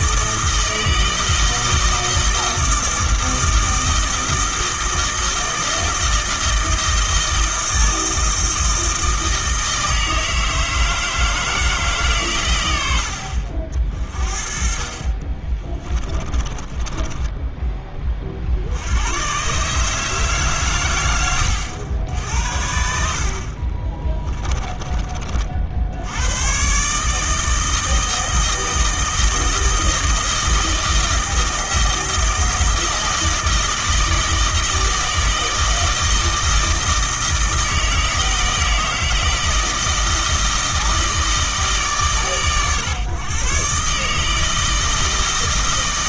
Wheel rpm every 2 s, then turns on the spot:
160, 160, 160, 160, 160, 160, 80, 40, 20, 80, 130, 60, 20, 130, 160, 160, 160, 160, 160, 160, 160, 130, 160.
16-18 24-26